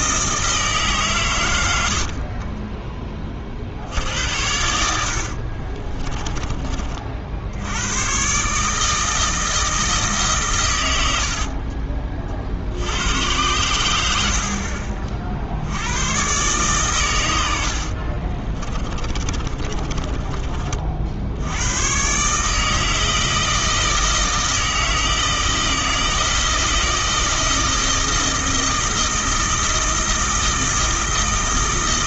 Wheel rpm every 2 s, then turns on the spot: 150, 20, 70, 30, 150, 100, 80, 50, 120, 20, 40, 160, 160, 160, 160, 160.
18-20